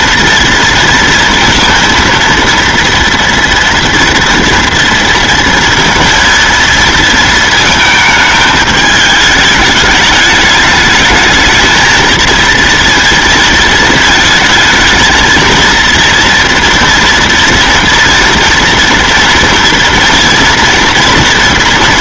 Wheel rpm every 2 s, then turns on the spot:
230, 230, 230, 230, 220, 210, 230, 220, 230, 230, 230.
none